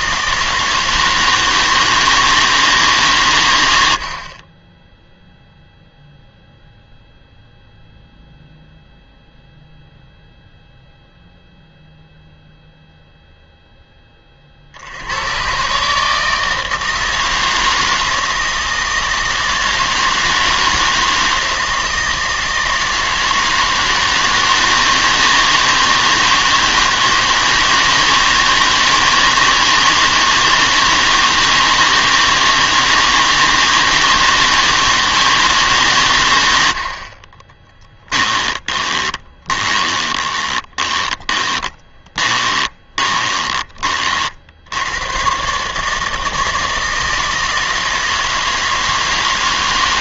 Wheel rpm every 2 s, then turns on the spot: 160, 150, 10, 0, 0, 0, 0, 70, 160, 160, 160, 160, 160, 160, 160, 160, 160, 160, 70, 30, 20, 20, 90, 160, 160.
38-44